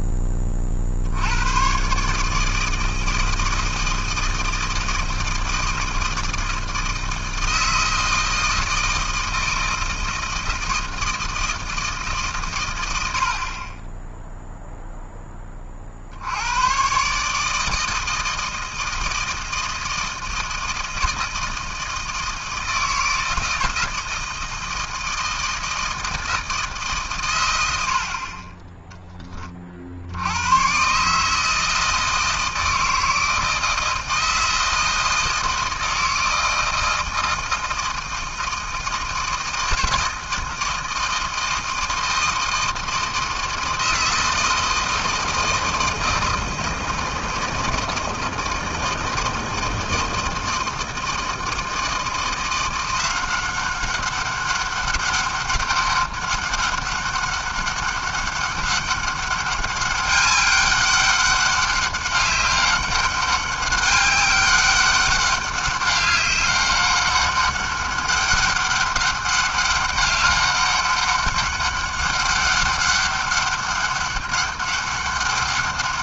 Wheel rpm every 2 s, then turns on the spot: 20, 150, 160, 160, 160, 160, 130, 0, 100, 160, 160, 160, 160, 150, 20, 140, 160, 160, 160, 160, 160, 160, 160, 160, 160, 160, 190, 200, 200, 200, 200, 200, 200, 200, 200, 200, 200, 200.
none